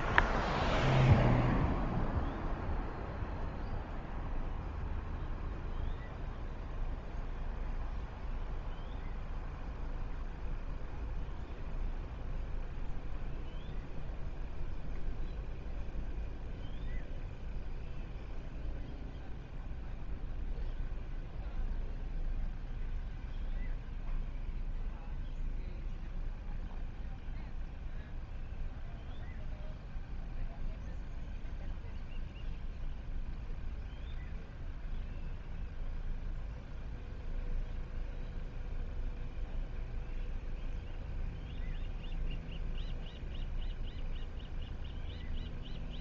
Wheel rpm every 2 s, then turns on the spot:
0, 0, 0, 0, 0, 0, 0, 0, 0, 0, 0, 0, 0, 0, 0, 0, 0, 0, 0, 0, 0, 0, 0.
none